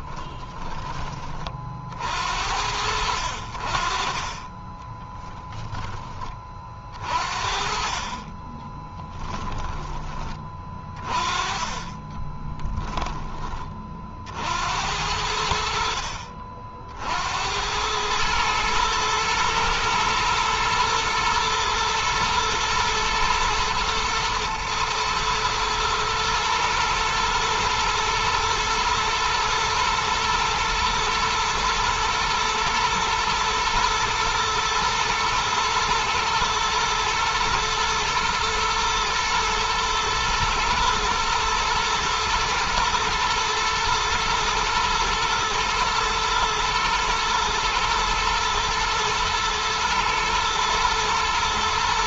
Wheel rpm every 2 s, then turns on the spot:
30, 60, 10, 40, 10, 30, 10, 80, 60, 110, 110, 110, 110, 110, 110, 120, 110, 120, 110, 110, 120, 120, 110, 110, 120, 110.
4-6 8-10